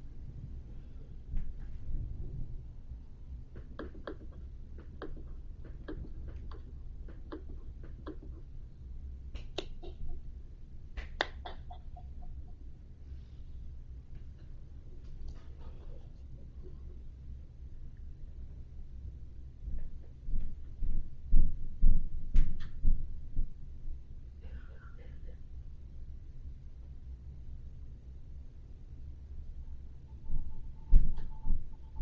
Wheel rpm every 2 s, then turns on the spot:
0, 0, 0, 0, 0, 0, 0, 0, 0, 0, 0, 0, 0, 0, 0, 0.
none